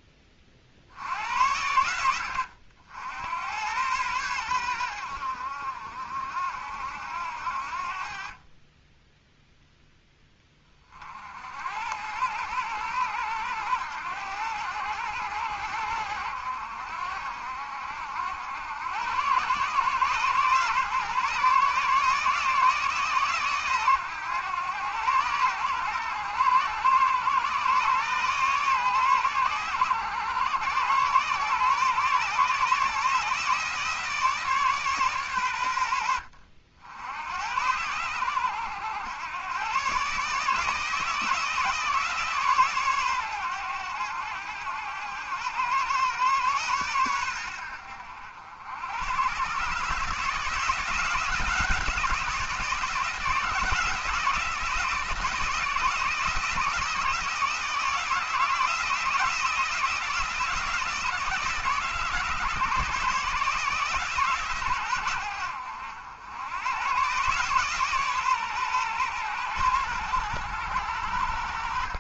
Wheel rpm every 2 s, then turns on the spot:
50, 70, 90, 70, 20, 40, 90, 90, 70, 90, 130, 150, 110, 110, 130, 120, 150, 150, 80, 100, 160, 140, 90, 110, 90, 170, 170, 160, 160, 160, 160, 150, 120, 100, 130, 100.
none